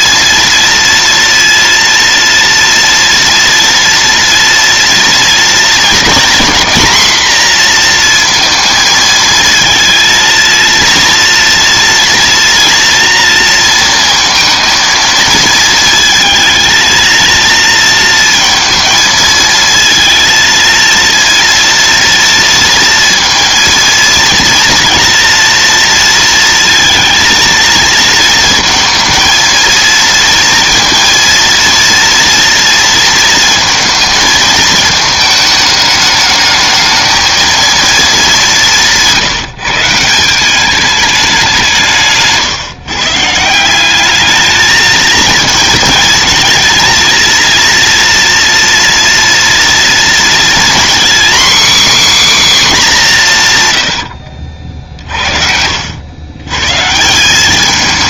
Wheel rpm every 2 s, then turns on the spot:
230, 230, 230, 250, 230, 230, 230, 230, 230, 230, 230, 230, 230, 230, 230, 230, 230, 220, 220, 160, 210, 140, 220, 230, 230, 250, 210, 60, 140.
54-56